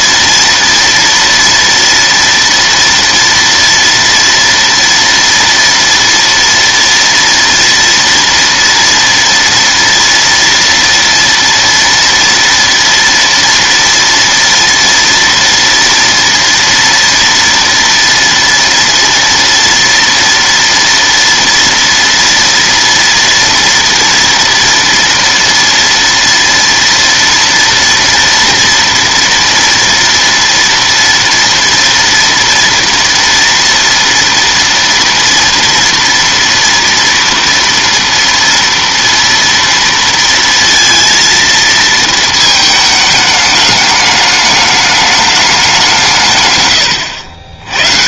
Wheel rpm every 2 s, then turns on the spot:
230, 230, 230, 230, 230, 230, 230, 230, 230, 230, 230, 230, 230, 230, 230, 230, 230, 240, 230, 230, 230, 230, 210, 160.
none